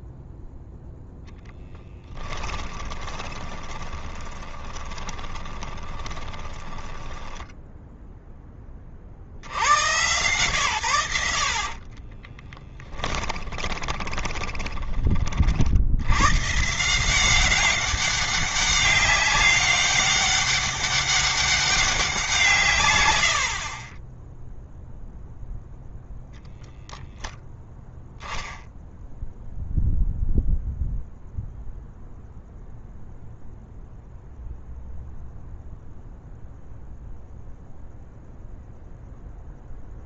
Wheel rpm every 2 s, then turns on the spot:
0, 10, 10, 10, 20, 120, 20, 20, 140, 200, 200, 150, 0, 0, 0, 0, 0, 0, 0, 0.
2-8 12-16